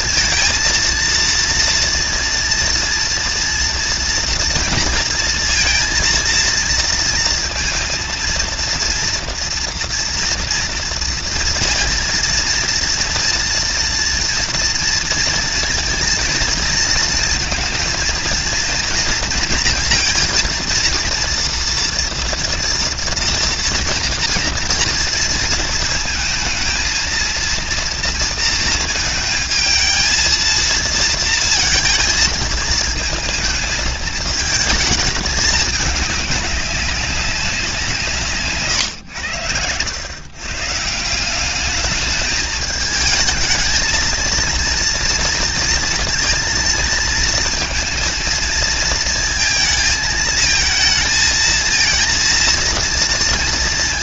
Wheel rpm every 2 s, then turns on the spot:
230, 230, 230, 230, 230, 230, 230, 230, 230, 230, 230, 230, 230, 230, 220, 230, 220, 220, 200, 130, 140, 210, 230, 230, 230, 220, 230.
none